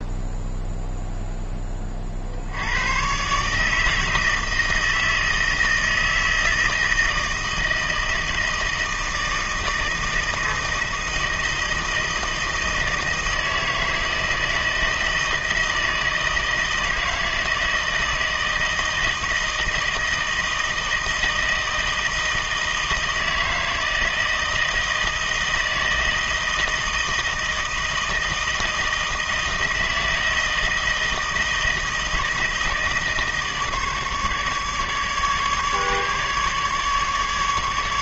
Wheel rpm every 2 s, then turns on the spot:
0, 100, 160, 160, 160, 160, 160, 160, 160, 160, 160, 160, 160, 160, 160, 160, 160, 150, 150.
none